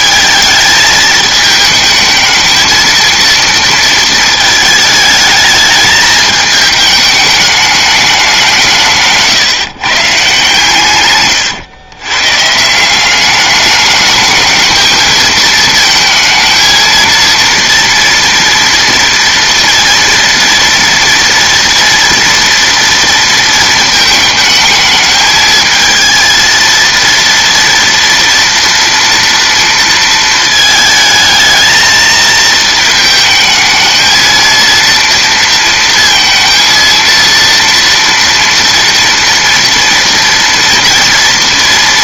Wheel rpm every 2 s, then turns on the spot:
220, 220, 220, 210, 170, 140, 160, 220, 230, 230, 230, 240, 220, 230, 230, 220, 220, 230, 230, 230, 230.
none